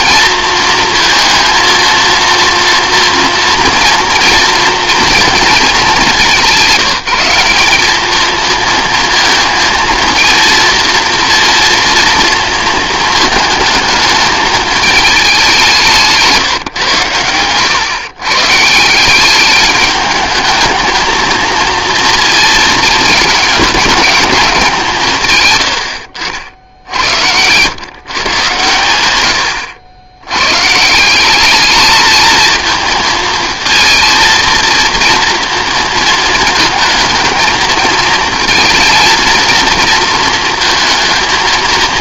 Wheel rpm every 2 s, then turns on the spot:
230, 230, 230, 190, 230, 230, 220, 220, 120, 160, 220, 230, 170, 70, 110, 140, 230, 230, 220, 230, 230.
none